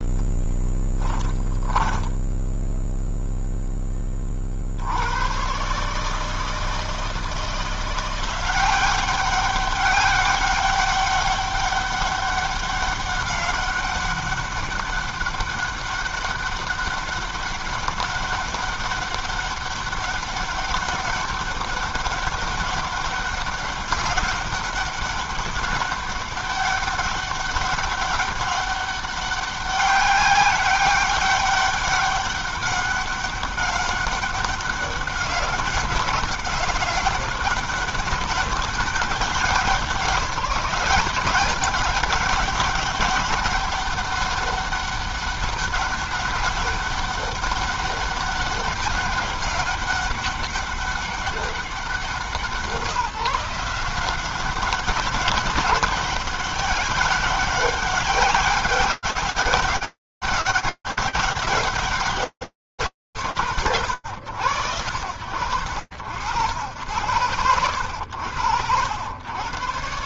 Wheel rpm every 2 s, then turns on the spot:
10, 0, 70, 160, 190, 200, 200, 200, 200, 190, 200, 200, 200, 200, 190, 190, 200, 200, 190, 200, 180, 200, 200, 200, 200, 190, 170, 190, 200, 190, 150, 100, 90, 70, 140.
0-2